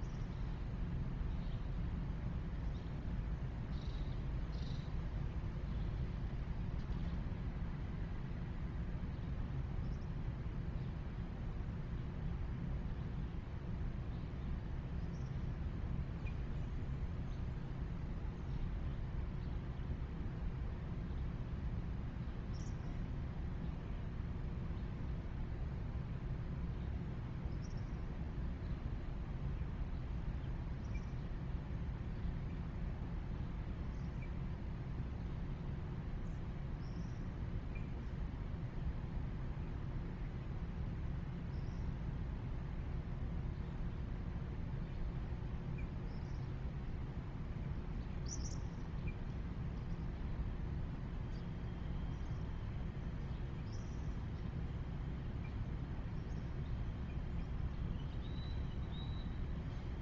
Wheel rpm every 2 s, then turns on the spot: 0, 0, 0, 0, 0, 0, 0, 0, 0, 0, 0, 0, 0, 0, 0, 0, 0, 0, 0, 0, 0, 0, 0, 0, 0, 0, 0, 0, 0, 0.
none